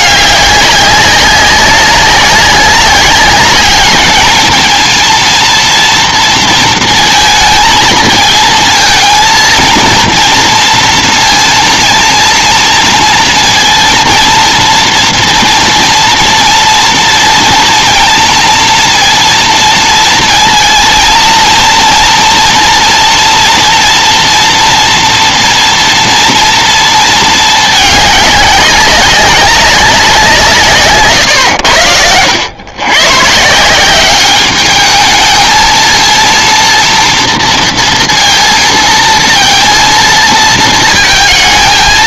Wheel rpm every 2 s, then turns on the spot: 200, 200, 230, 230, 230, 230, 230, 230, 230, 230, 230, 230, 230, 230, 190, 140, 110, 210, 230, 230, 230.
none